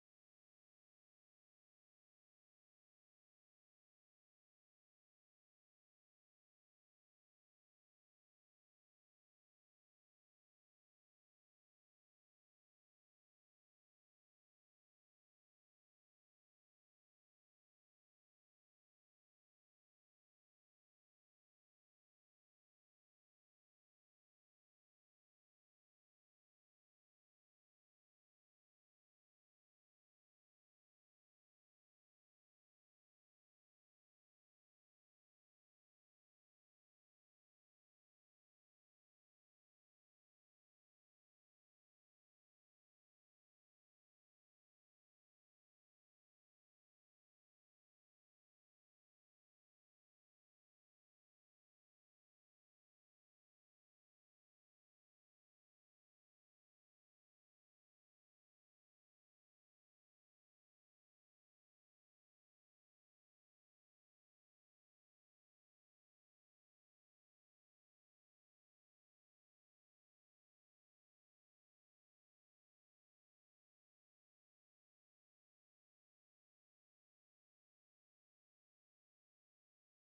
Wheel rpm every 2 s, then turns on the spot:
0, 20, 50, 30, 0, 0, 20, 70, 80, 40, 40, 60, 40, 50, 70, 60, 30, 40, 50, 70, 160, 70, 80, 100, 120, 170, 130, 160, 60, 70, 140, 130, 210, 210, 140, 160, 210, 200, 80, 140.
20-22 42-44 46-48 58-60